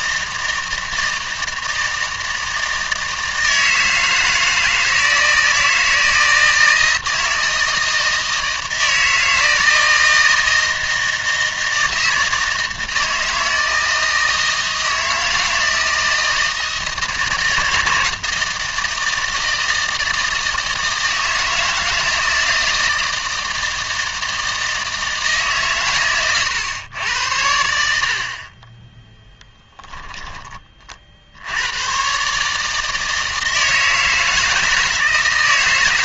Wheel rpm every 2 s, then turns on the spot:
160, 160, 160, 160, 160, 160, 160, 160, 160, 160, 160, 160, 160, 120, 20, 40, 150, 160.
none